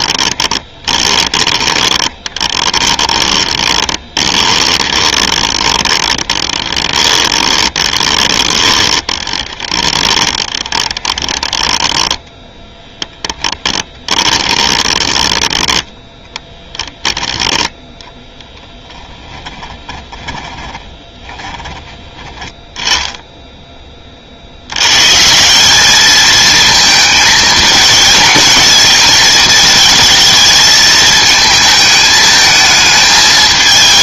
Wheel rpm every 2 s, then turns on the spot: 20, 20, 20, 20, 20, 20, 10, 20, 10, 10, 20, 10, 90, 220, 220, 220, 220.
0-12 14-16 18-22